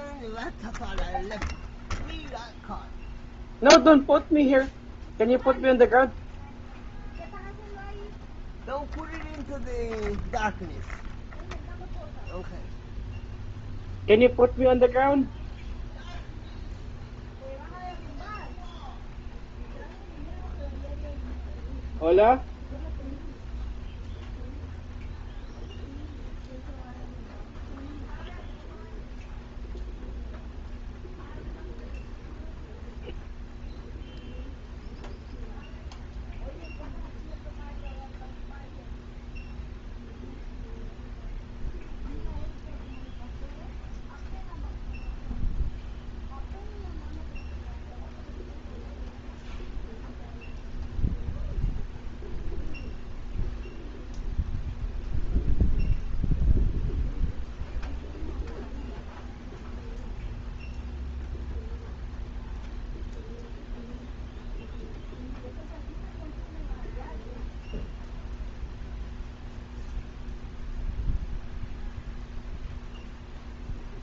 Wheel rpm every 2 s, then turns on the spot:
0, 0, 0, 0, 0, 0, 0, 0, 0, 0, 0, 0, 0, 0, 0, 0, 0, 0, 0, 0, 0, 0, 0, 0, 0, 0, 0, 0, 0, 0, 0, 0, 0, 0, 0, 0, 0.
none